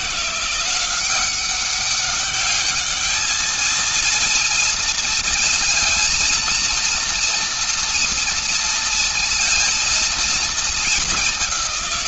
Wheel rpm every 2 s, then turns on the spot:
180, 210, 230, 230, 230, 220.
none